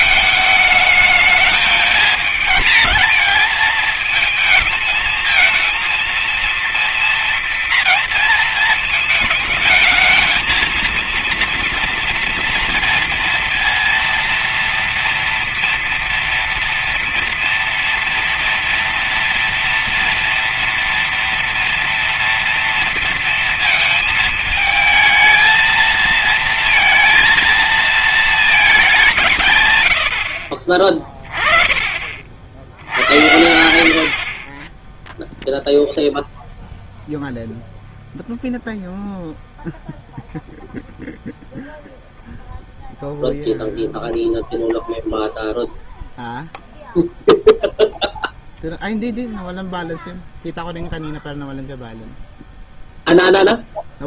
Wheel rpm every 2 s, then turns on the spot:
220, 220, 220, 230, 220, 230, 230, 230, 230, 230, 230, 230, 220, 230, 180, 30, 80, 10, 0, 0, 0, 0, 0, 0, 0, 0, 0.
none